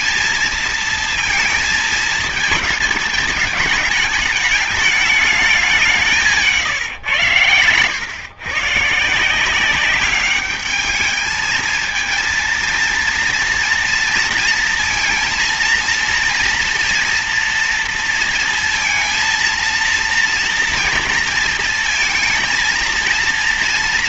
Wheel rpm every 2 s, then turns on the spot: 230, 220, 210, 160, 120, 200, 230, 230, 230, 230, 230, 230.
none